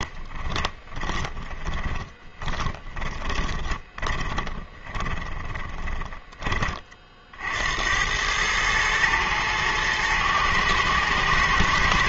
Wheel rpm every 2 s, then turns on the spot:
30, 20, 20, 20, 110, 110.
0-6